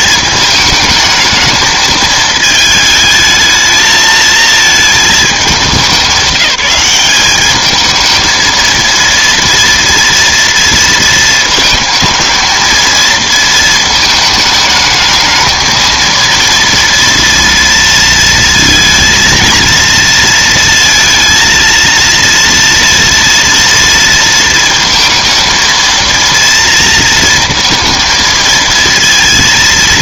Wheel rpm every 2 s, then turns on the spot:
220, 220, 220, 190, 230, 230, 230, 220, 230, 230, 230, 230, 230, 230, 230.
none